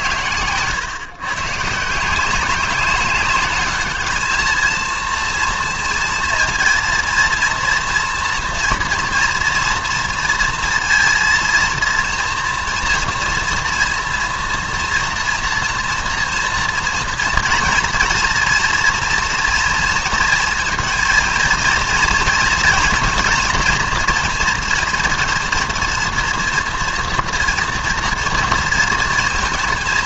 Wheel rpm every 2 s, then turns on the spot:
120, 200, 230, 230, 230, 230, 240, 230, 230, 230, 230, 230, 230, 230, 230.
none